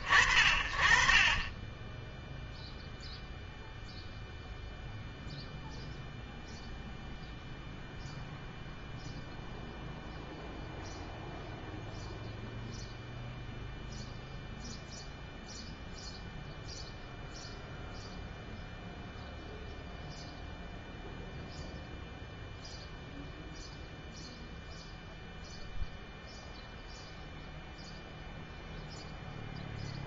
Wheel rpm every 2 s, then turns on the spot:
40, 10, 0, 0, 0, 0, 0, 0, 0, 0, 0, 0, 0, 0, 0.
none